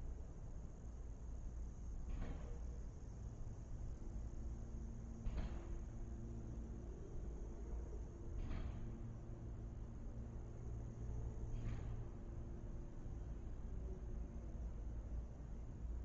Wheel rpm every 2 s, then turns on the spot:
0, 0, 0, 0, 0, 0, 0, 0.
none